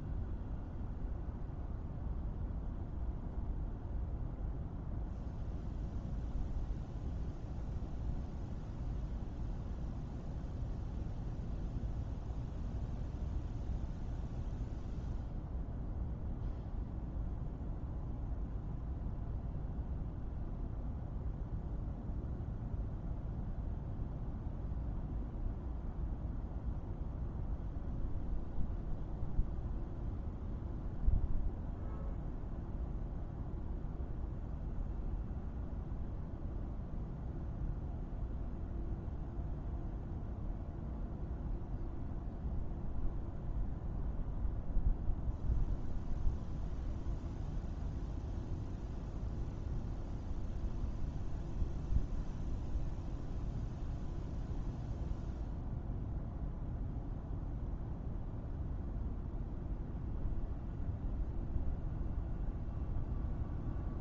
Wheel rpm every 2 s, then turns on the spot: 0, 0, 0, 0, 0, 0, 0, 0, 0, 0, 0, 0, 0, 0, 0, 0, 0, 0, 0, 0, 0, 0, 0, 0, 0, 0, 0, 0, 0, 0, 0, 0.
none